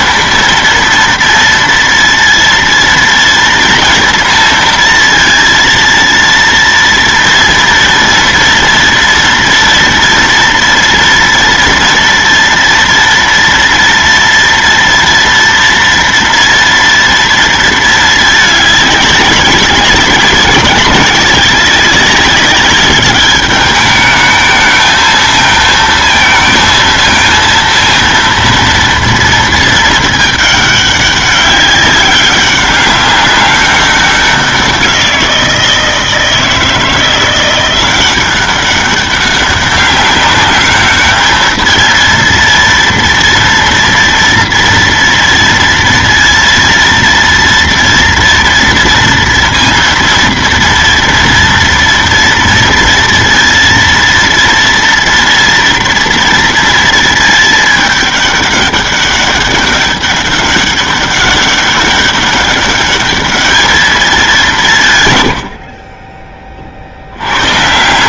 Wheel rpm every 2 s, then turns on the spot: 230, 230, 230, 230, 240, 230, 230, 230, 230, 210, 200, 200, 220, 220, 230, 200, 200, 180, 160, 190, 210, 230, 230, 230, 230, 230, 230, 230, 230, 200, 200, 200, 150, 50.
none